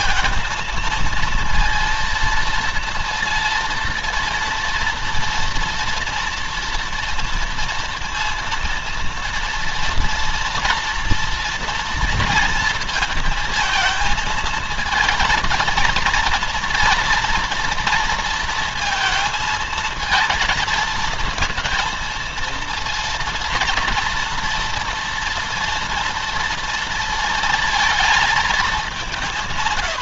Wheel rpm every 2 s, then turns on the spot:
230, 230, 230, 230, 230, 240, 230, 220, 230, 230, 230, 230, 230, 230, 200.
none